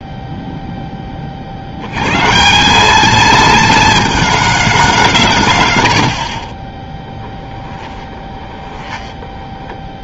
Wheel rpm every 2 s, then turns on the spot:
0, 170, 210, 30, 20.
8-10